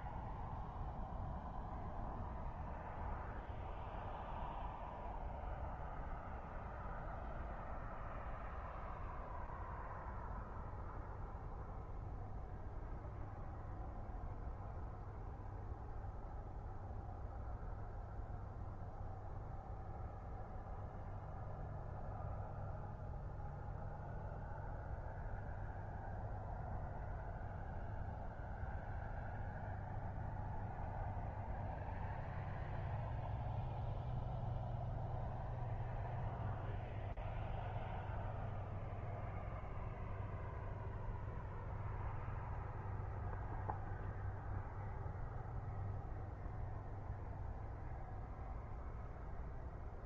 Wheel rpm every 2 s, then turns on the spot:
0, 0, 0, 0, 0, 0, 0, 0, 0, 0, 0, 0, 0, 0, 0, 0, 0, 0, 0, 0, 0, 0, 0, 0, 0.
none